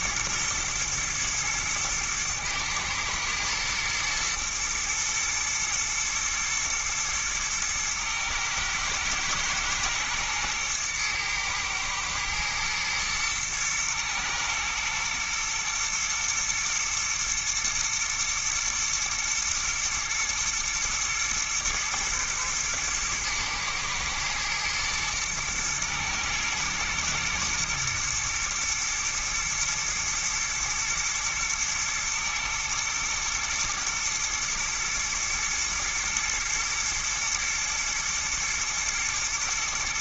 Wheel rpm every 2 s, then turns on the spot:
120, 110, 110, 110, 110, 110, 120, 120, 110, 120, 110, 110, 110, 110, 120, 110, 120, 120, 120, 110.
none